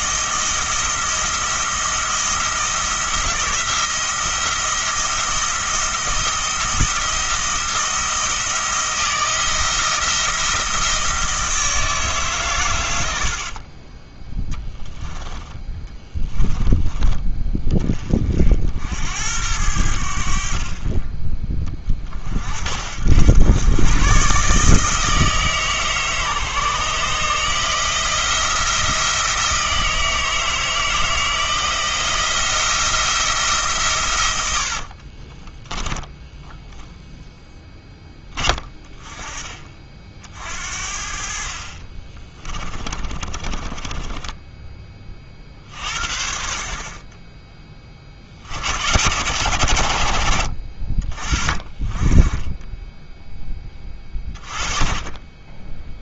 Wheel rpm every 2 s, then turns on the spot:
170, 170, 170, 160, 170, 170, 120, 10, 20, 60, 30, 70, 150, 150, 170, 160, 170, 100, 10, 20, 60, 20, 20, 40, 80, 40, 20, 30.
14-16 42-44